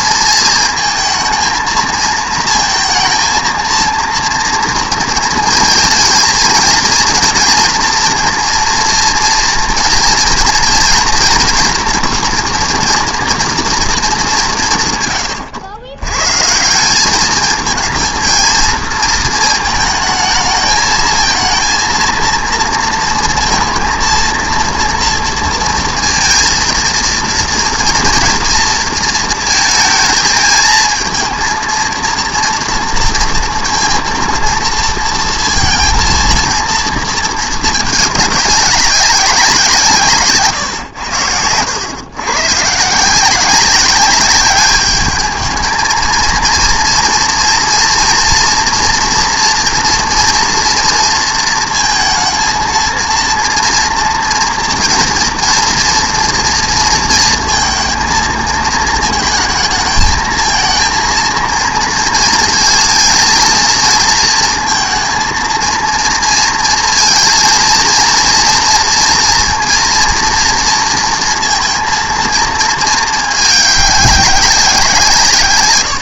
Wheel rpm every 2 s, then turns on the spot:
230, 230, 230, 230, 230, 230, 230, 160, 160, 230, 220, 230, 230, 230, 230, 220, 230, 230, 230, 190, 130, 130, 200, 230, 230, 230, 230, 230, 230, 220, 220, 230, 230, 230, 230, 230, 220, 180.
none